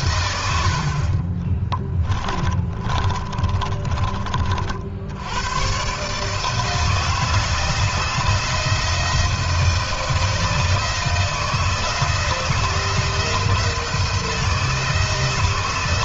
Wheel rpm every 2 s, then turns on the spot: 40, 30, 100, 170, 170, 160, 170, 160.
0-4